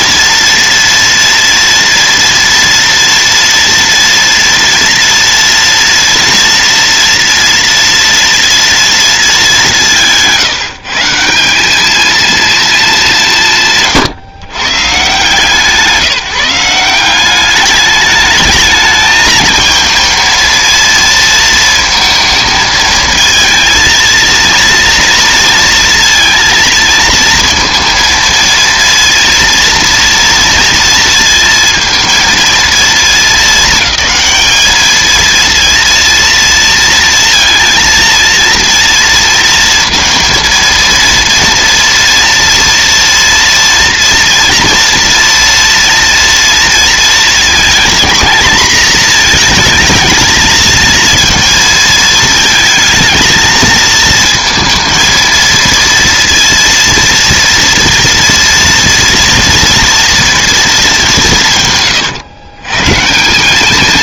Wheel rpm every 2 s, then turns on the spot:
230, 230, 230, 230, 230, 160, 220, 130, 170, 220, 230, 220, 230, 230, 230, 230, 220, 210, 230, 230, 230, 230, 230, 230, 220, 220, 220, 220, 230, 230, 220, 130.
none